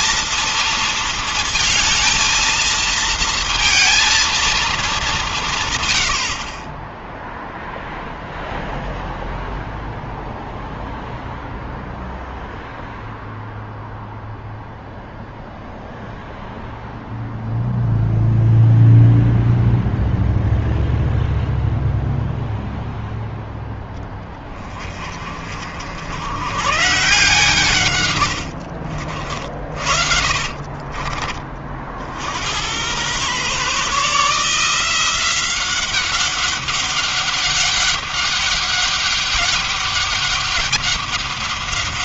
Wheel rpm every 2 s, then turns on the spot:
230, 230, 200, 0, 0, 0, 0, 0, 0, 0, 0, 0, 40, 140, 50, 30, 110, 170, 200, 200, 200.
30-32